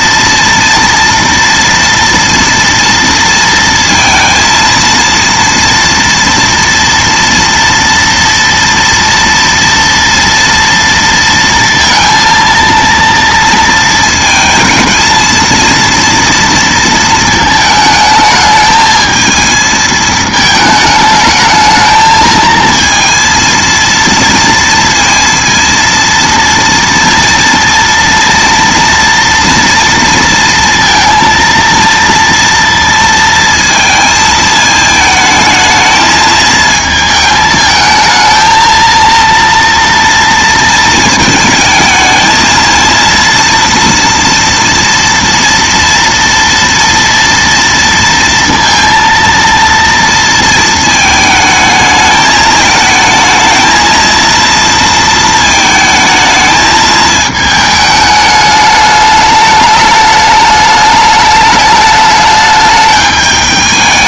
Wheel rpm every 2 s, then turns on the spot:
230, 230, 230, 240, 230, 230, 230, 220, 230, 220, 220, 230, 230, 230, 230, 230, 230, 220, 220, 220, 220, 230, 230, 230, 230, 220, 220, 230, 220, 210, 210, 210.
none